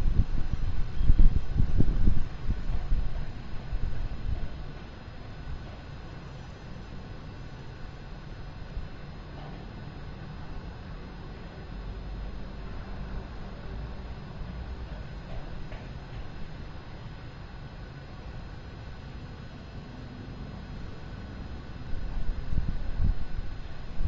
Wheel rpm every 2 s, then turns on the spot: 0, 0, 0, 0, 0, 0, 0, 0, 0, 0, 0, 0.
none